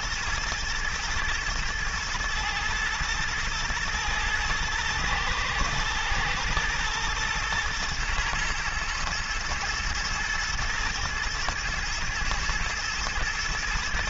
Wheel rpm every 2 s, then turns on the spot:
120, 120, 110, 110, 110, 120, 120.
none